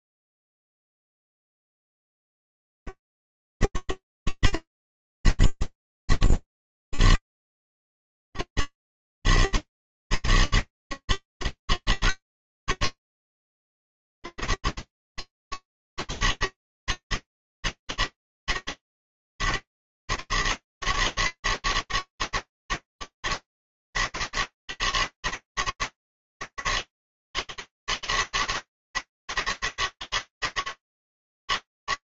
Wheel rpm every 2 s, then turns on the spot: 80, 100, 110, 50, 80, 110, 110, 100, 110, 110, 110, 110, 110, 110, 110, 110.
none